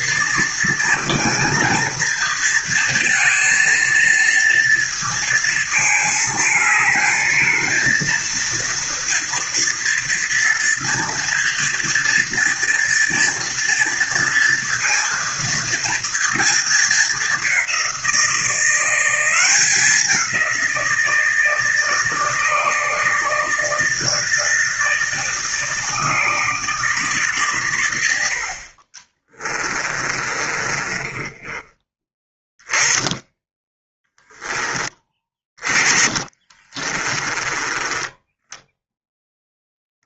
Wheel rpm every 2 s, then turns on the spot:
230, 230, 230, 220, 230, 230, 240, 230, 220, 180, 170, 160, 160, 150, 30, 20, 20, 10, 20, 10.
28-32 36-38